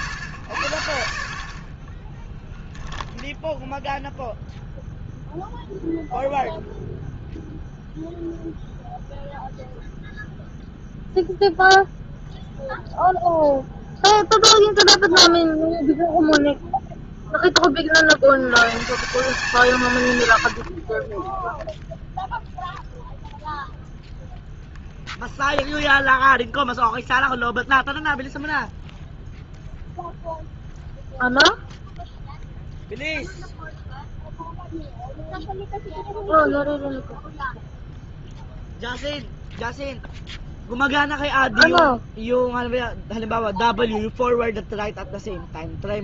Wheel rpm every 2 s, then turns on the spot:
80, 10, 0, 0, 0, 0, 0, 0, 0, 90, 100, 0, 0, 10, 0, 0, 0, 0, 0, 0, 0, 0, 0.
2-4 26-28